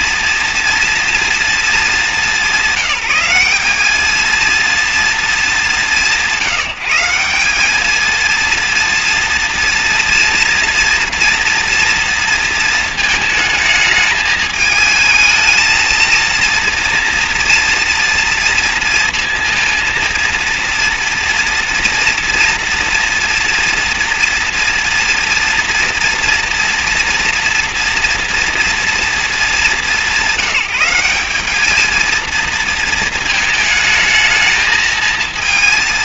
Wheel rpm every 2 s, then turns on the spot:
230, 200, 230, 170, 230, 240, 220, 220, 230, 230, 230, 240, 230, 230, 230, 200, 230, 220.
none